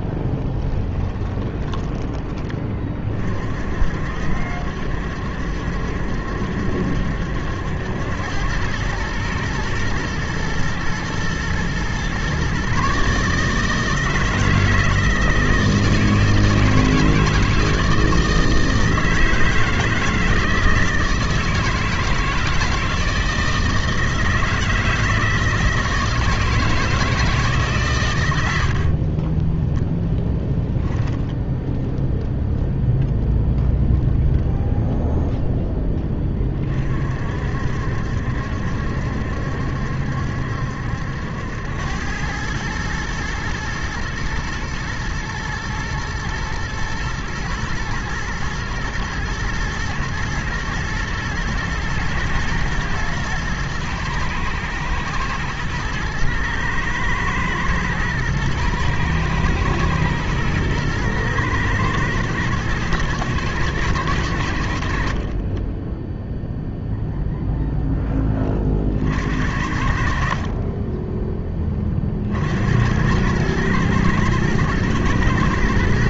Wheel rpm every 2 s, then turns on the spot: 20, 20, 70, 70, 100, 110, 130, 160, 160, 160, 160, 160, 160, 160, 80, 10, 0, 0, 30, 70, 70, 110, 120, 120, 120, 110, 120, 110, 110, 110, 120, 110, 50, 0, 30, 40, 70, 110.
0-2 30-32